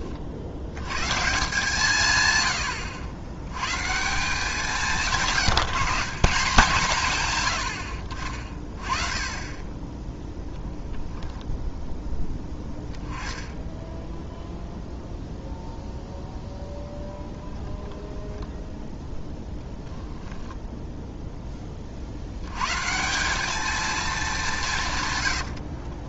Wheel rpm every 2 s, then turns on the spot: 60, 90, 160, 170, 30, 0, 10, 0, 0, 0, 10, 100, 180.
8-10